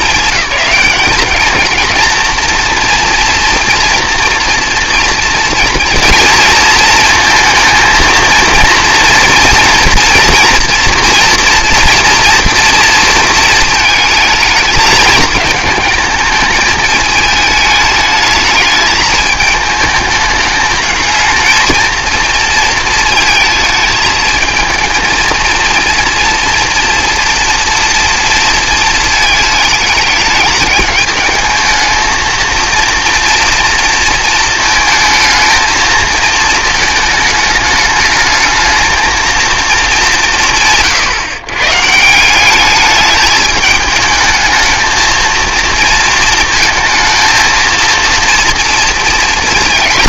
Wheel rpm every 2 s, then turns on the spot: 220, 240, 230, 230, 230, 230, 230, 220, 210, 210, 220, 220, 220, 240, 230, 210, 230, 230, 220, 220, 100, 200, 220, 220, 230.
none